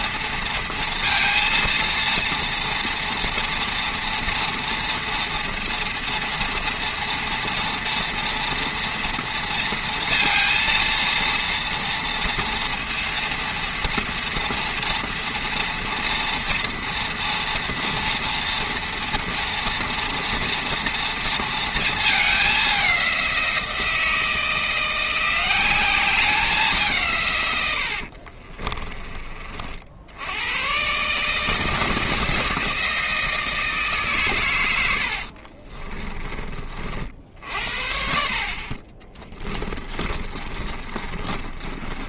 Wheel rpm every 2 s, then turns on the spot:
230, 230, 230, 230, 230, 230, 230, 240, 230, 230, 240, 190, 170, 160, 30, 130, 160, 80, 50, 30, 30.
28-30 34-36 40-42